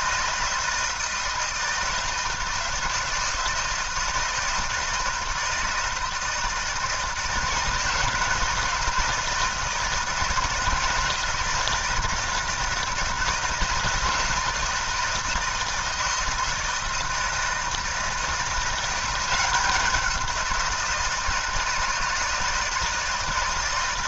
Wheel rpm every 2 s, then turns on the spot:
160, 160, 160, 160, 160, 160, 160, 160, 160, 170, 180, 160.
none